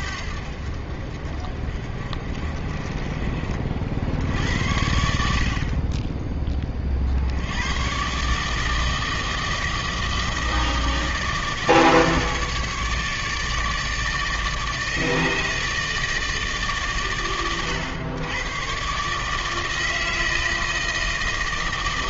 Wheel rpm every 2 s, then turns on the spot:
60, 40, 80, 30, 160, 160, 150, 150, 140, 120, 160.
none